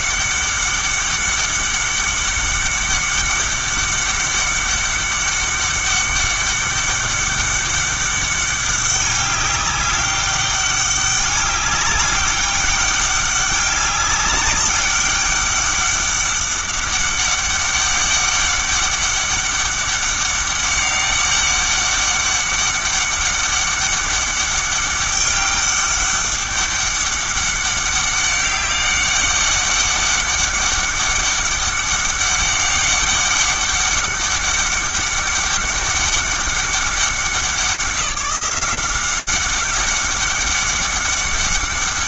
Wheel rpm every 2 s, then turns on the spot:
200, 200, 200, 200, 200, 200, 200, 200, 200, 200, 200, 200, 200, 200, 200, 200, 200, 200, 200, 180, 200.
none